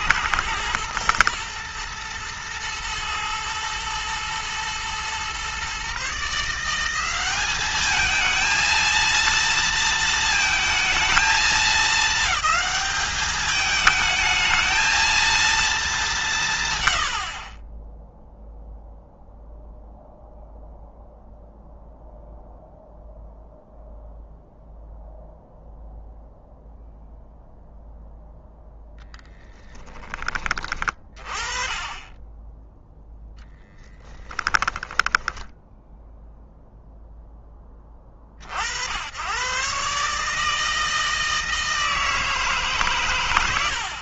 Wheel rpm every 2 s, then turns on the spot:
120, 110, 120, 180, 230, 220, 210, 220, 100, 0, 0, 0, 0, 0, 0, 30, 10, 10, 0, 80, 160, 130.
32-36